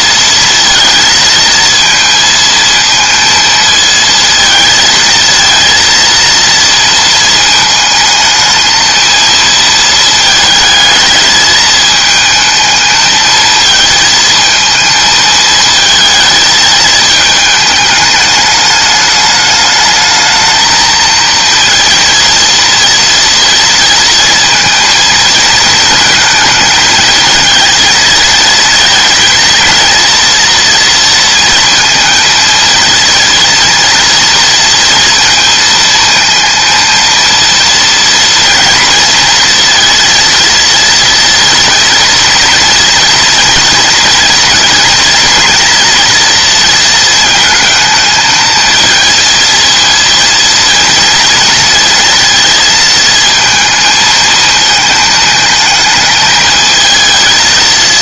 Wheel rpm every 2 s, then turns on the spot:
230, 220, 220, 230, 220, 220, 220, 220, 220, 210, 220, 230, 230, 220, 220, 230, 230, 230, 230, 230, 230, 230, 230, 230, 220, 230, 220, 220, 220.
none